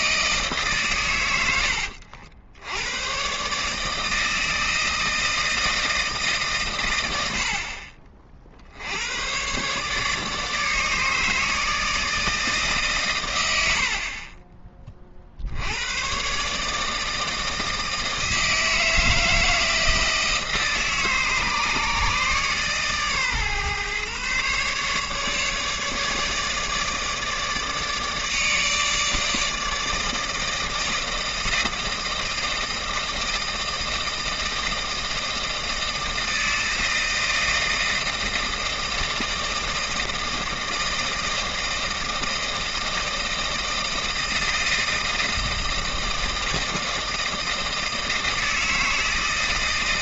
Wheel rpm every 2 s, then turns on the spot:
140, 90, 160, 120, 70, 150, 150, 30, 150, 160, 160, 140, 140, 150, 150, 160, 160, 160, 160, 160, 160, 160, 160, 160, 160.
none